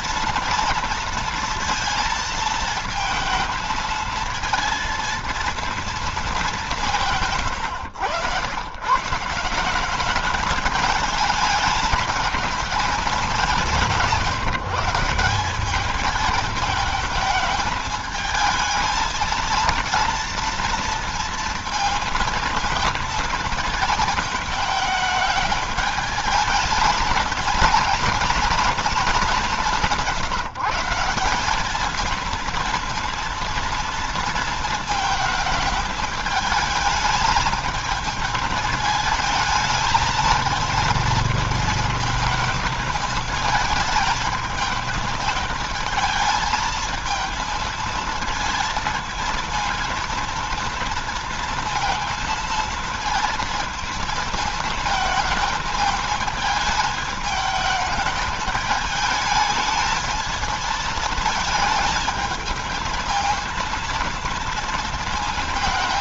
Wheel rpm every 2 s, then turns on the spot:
230, 220, 230, 180, 120, 220, 220, 180, 210, 220, 230, 220, 220, 220, 230, 160, 230, 230, 220, 220, 230, 220, 220, 220, 230, 230, 230, 220, 220, 210, 220, 220, 220.
none